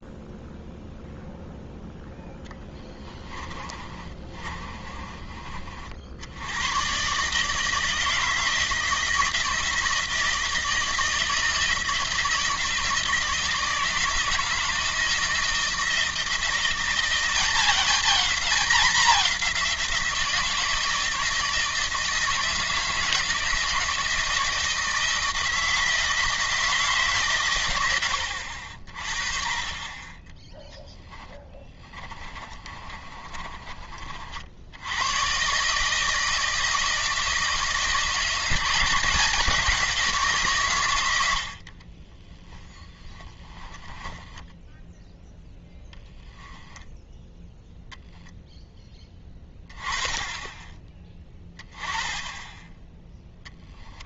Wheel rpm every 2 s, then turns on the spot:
0, 10, 30, 120, 160, 160, 160, 160, 170, 200, 160, 160, 160, 160, 50, 10, 30, 90, 160, 180, 120, 10, 10, 10, 10, 10, 10.
2-6 32-34 42-44 46-48